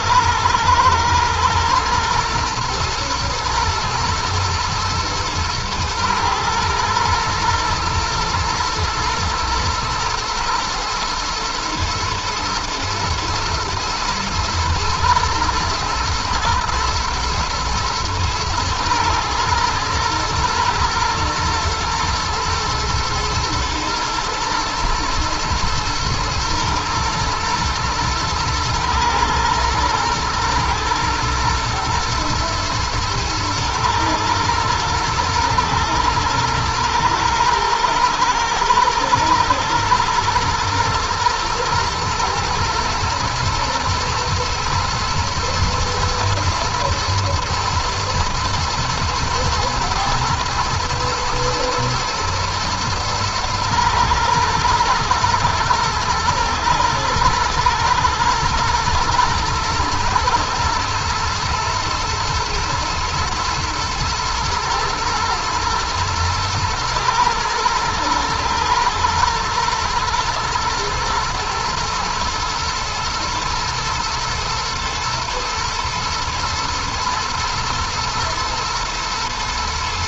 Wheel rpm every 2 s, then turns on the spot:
110, 120, 110, 110, 120, 120, 110, 120, 110, 110, 110, 120, 110, 120, 120, 110, 110, 110, 110, 120, 120, 110, 120, 120, 120, 110, 120, 120, 110, 110, 110, 110, 110, 110, 120, 110, 110, 110, 110, 110.
none